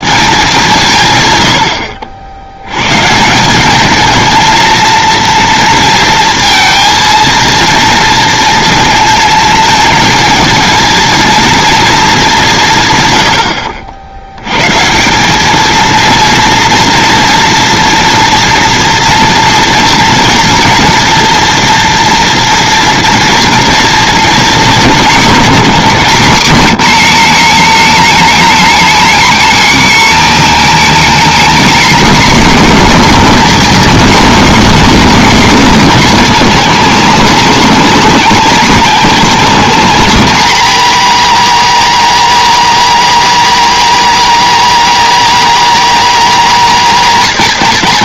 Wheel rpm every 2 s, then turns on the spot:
160, 120, 230, 230, 230, 220, 140, 150, 230, 230, 230, 230, 220, 240, 260, 270, 270, 270, 290, 280, 290, 290, 290, 240.
none